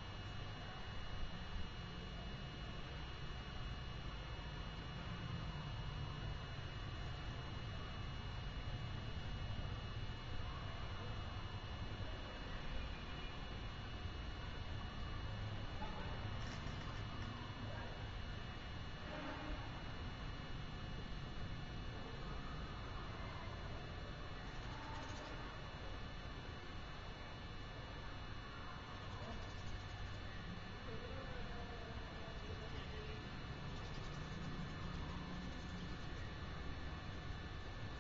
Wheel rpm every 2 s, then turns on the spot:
0, 0, 0, 0, 0, 0, 0, 0, 0, 0, 0, 0, 0, 0, 0, 0, 0, 0, 0.
none